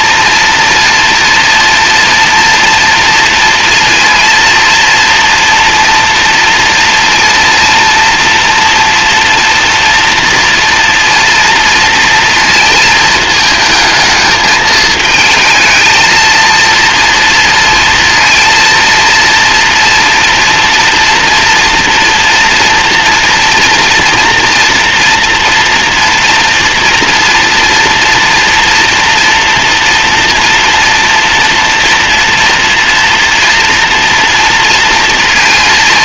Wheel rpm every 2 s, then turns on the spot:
240, 230, 230, 240, 240, 240, 220, 220, 230, 230, 240, 230, 230, 230, 230, 230, 230, 230.
none